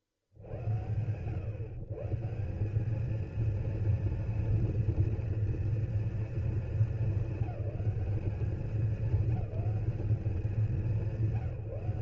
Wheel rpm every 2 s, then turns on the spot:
60, 170, 230, 230, 200, 190.
none